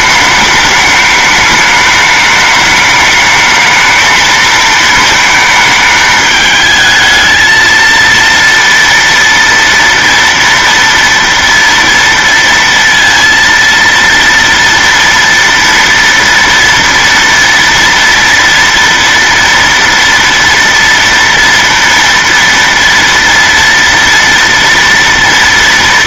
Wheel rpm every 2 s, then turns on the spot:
210, 210, 220, 220, 230, 230, 230, 240, 230, 230, 240, 230, 230.
none